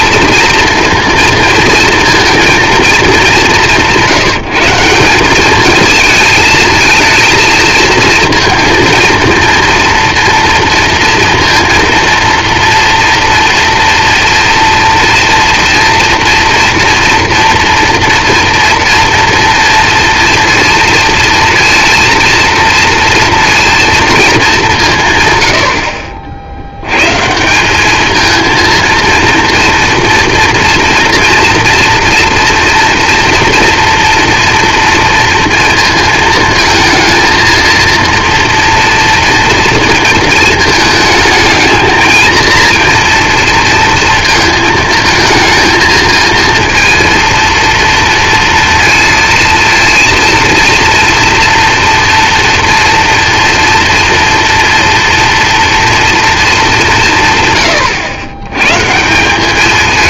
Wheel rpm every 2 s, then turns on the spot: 230, 210, 190, 230, 230, 230, 230, 230, 230, 230, 230, 230, 160, 110, 230, 230, 240, 230, 220, 230, 220, 230, 220, 230, 230, 240, 230, 230, 180, 150.
none